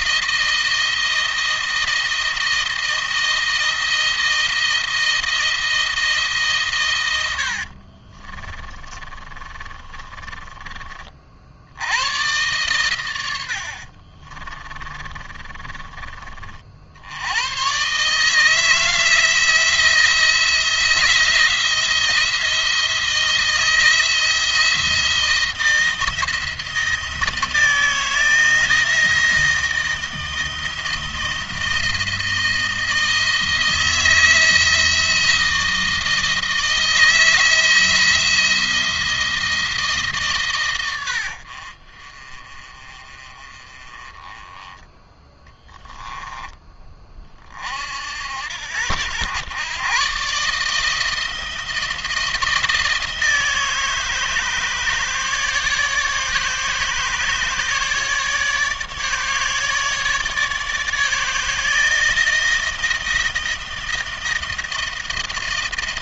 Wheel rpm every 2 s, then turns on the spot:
160, 170, 160, 130, 30, 30, 120, 30, 50, 160, 160, 170, 170, 160, 160, 160, 160, 170, 160, 170, 110, 30, 10, 20, 80, 150, 160, 150, 150, 150, 150, 160, 160.
8-10 14-16 44-46